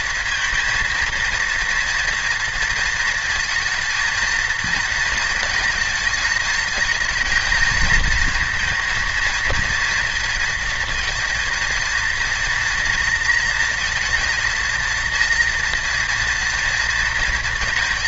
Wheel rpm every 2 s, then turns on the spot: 230, 230, 230, 220, 230, 220, 230, 230, 230.
none